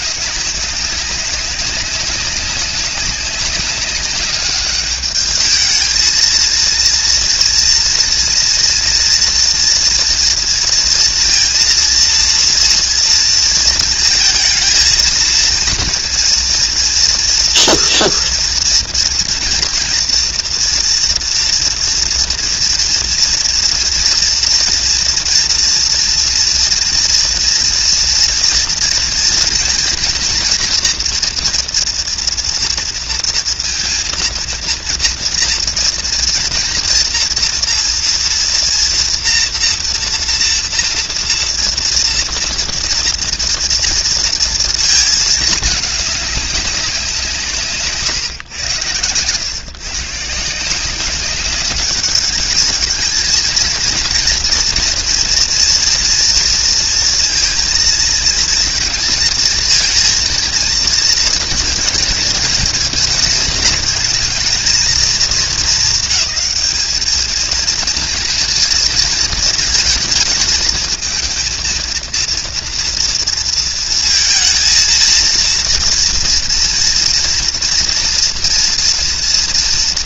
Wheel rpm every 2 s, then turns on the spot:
200, 190, 210, 230, 230, 230, 230, 220, 230, 230, 230, 230, 230, 230, 230, 230, 230, 230, 240, 230, 240, 230, 230, 200, 120, 180, 220, 230, 230, 220, 230, 220, 220, 210, 230, 220, 230, 230, 230, 240.
none